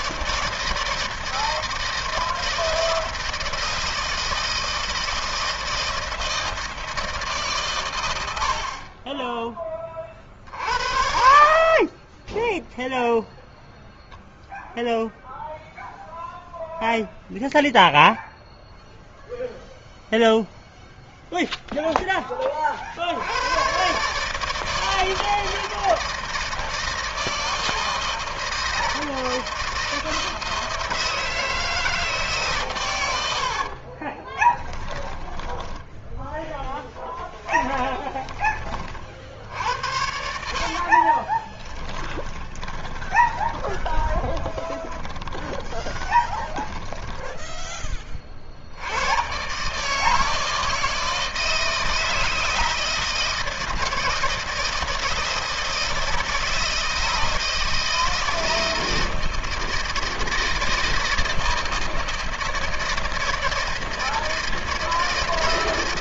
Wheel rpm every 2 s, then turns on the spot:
160, 160, 160, 160, 80, 40, 10, 0, 0, 0, 0, 20, 140, 160, 160, 160, 140, 20, 10, 40, 60, 20, 20, 10, 50, 160, 160, 160, 160, 160, 160, 160, 160.
34-36 40-48